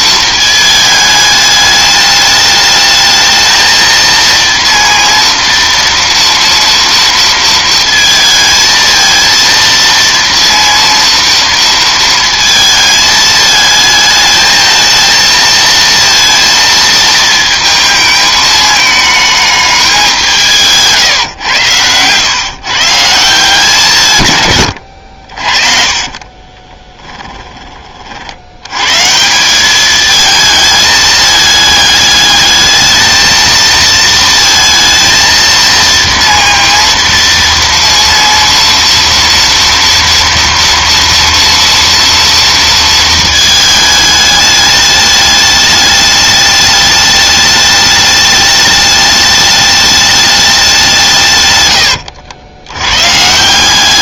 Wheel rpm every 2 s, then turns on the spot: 220, 210, 230, 230, 220, 230, 220, 220, 230, 220, 160, 140, 90, 20, 100, 220, 220, 230, 230, 230, 230, 230, 210, 210, 210, 190, 90.
20-22 26-28